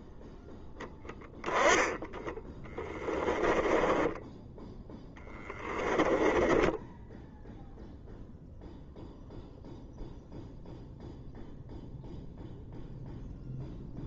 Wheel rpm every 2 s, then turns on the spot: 0, 10, 10, 10, 0, 0, 0.
2-8